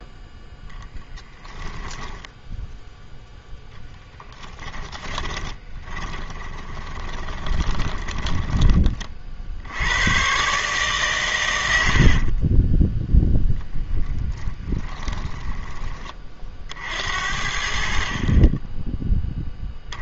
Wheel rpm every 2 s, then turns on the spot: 10, 0, 10, 20, 10, 130, 30, 10, 50, 20.
4-8 12-16